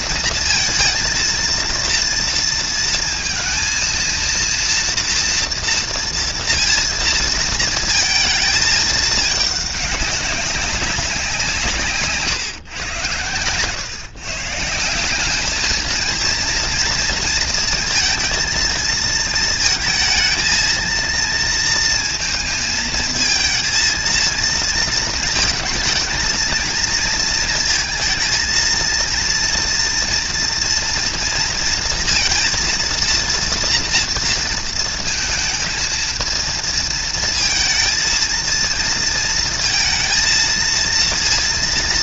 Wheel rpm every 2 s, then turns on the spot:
230, 230, 230, 230, 220, 200, 120, 170, 230, 230, 230, 220, 230, 220, 230, 230, 230, 230, 220, 230, 230.
none